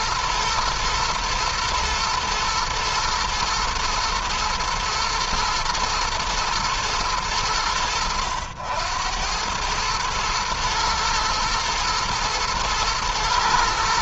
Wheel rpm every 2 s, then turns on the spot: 110, 110, 110, 100, 100, 110, 110.
none